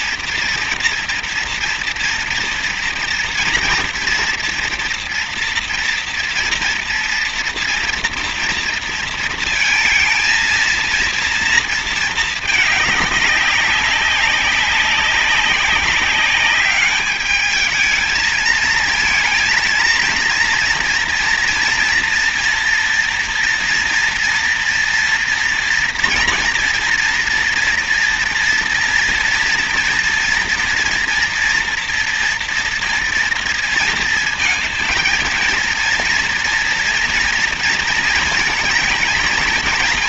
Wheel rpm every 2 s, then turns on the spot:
230, 230, 230, 230, 230, 230, 210, 190, 210, 230, 230, 230, 230, 230, 230, 230, 230, 230, 230, 220.
none